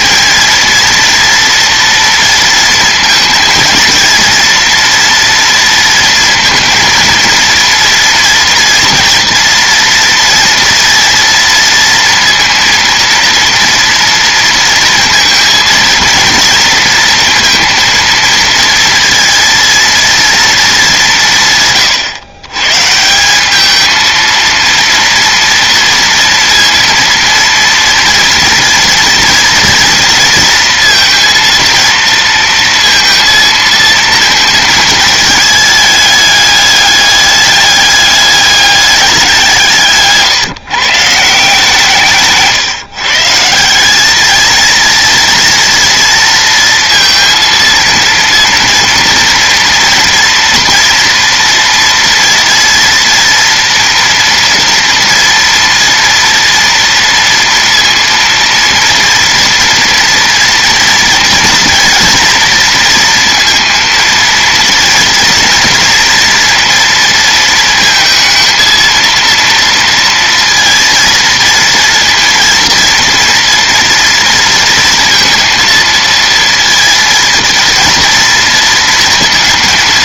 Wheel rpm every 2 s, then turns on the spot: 230, 220, 230, 230, 230, 230, 230, 230, 230, 230, 170, 150, 230, 230, 230, 230, 230, 220, 210, 190, 150, 140, 230, 230, 230, 230, 230, 230, 230, 230, 230, 230, 230, 230, 230, 230, 230, 230, 230, 230.
none